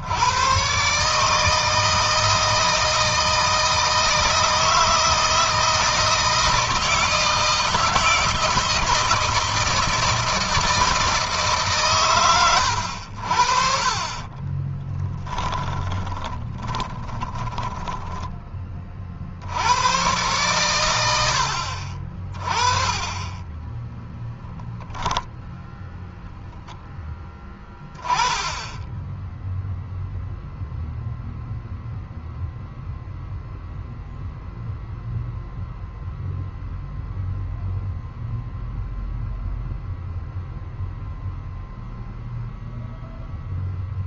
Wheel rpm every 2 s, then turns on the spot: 130, 160, 160, 160, 160, 160, 80, 20, 20, 30, 100, 30, 10, 10, 10, 0, 0, 0, 0, 0, 0, 0.
14-18 24-26